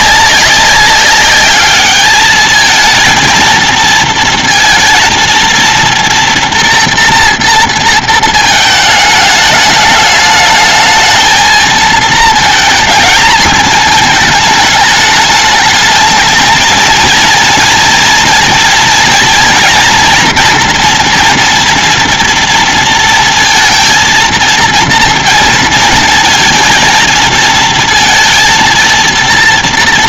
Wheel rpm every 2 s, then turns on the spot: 200, 210, 230, 230, 230, 210, 230, 220, 220, 230, 240, 230, 220, 230, 230.
none